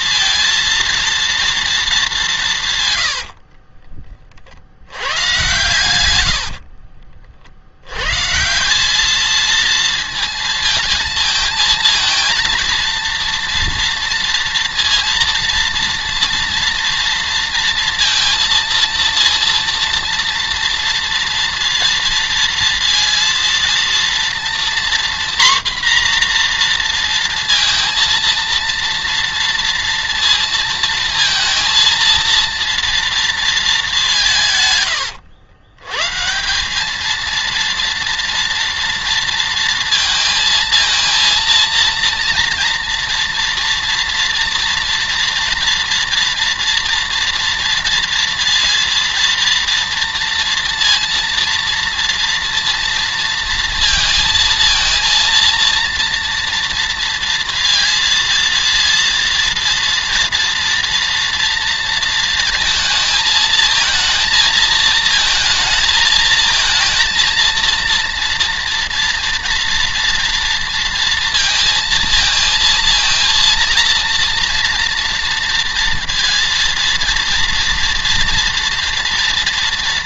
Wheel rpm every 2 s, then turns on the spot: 230, 150, 70, 50, 180, 230, 230, 230, 230, 230, 230, 230, 240, 240, 230, 230, 230, 130, 190, 240, 230, 230, 230, 230, 230, 230, 230, 230, 230, 230, 240, 220, 230, 220, 230, 230, 230, 230, 230, 230.
6-8